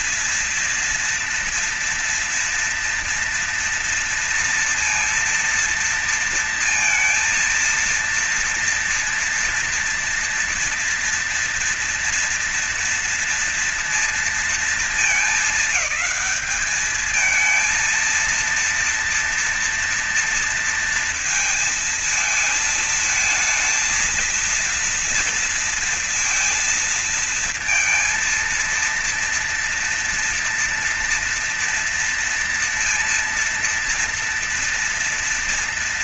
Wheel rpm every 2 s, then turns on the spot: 230, 230, 230, 230, 230, 230, 230, 220, 220, 230, 230, 220, 230, 230, 230, 230, 230, 230.
none